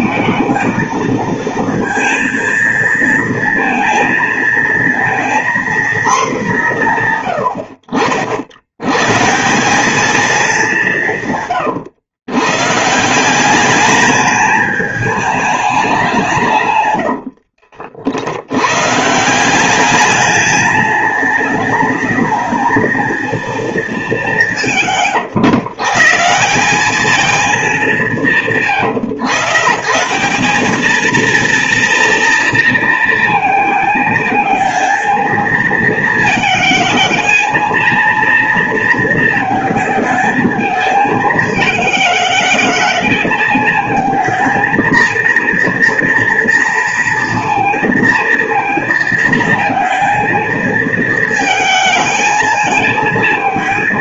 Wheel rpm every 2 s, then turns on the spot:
230, 230, 230, 200, 80, 210, 120, 210, 150, 80, 210, 220, 190, 190, 150, 190, 230, 220, 220, 230, 220, 220, 230, 230, 230, 220, 220.
none